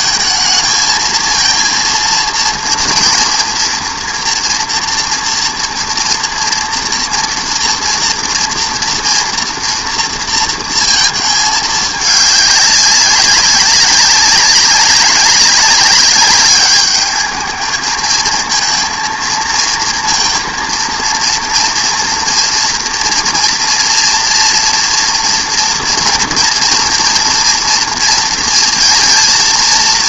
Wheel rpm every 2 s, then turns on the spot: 220, 230, 230, 230, 230, 230, 200, 190, 210, 230, 230, 240, 230, 230, 230.
none